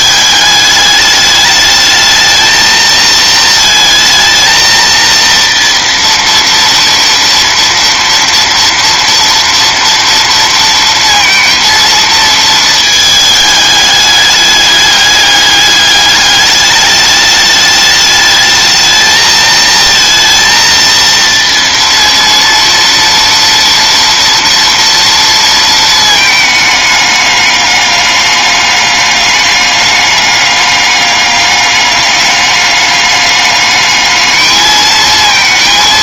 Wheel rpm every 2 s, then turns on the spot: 210, 220, 230, 230, 240, 230, 220, 210, 210, 220, 230, 240, 230, 210, 200, 200, 200, 220.
none